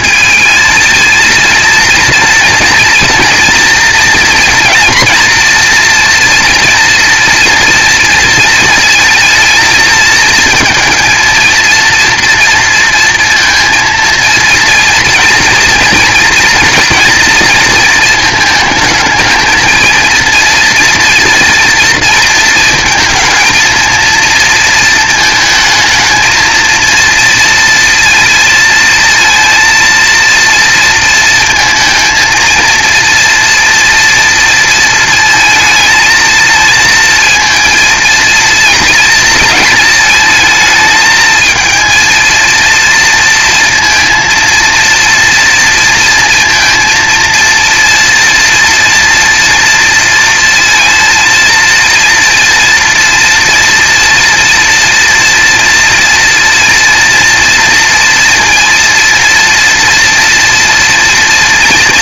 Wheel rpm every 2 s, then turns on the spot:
230, 230, 230, 230, 220, 230, 230, 230, 230, 220, 230, 220, 220, 230, 230, 230, 230, 230, 230, 230, 220, 230, 230, 230, 230, 230, 230, 230, 230, 230, 230.
none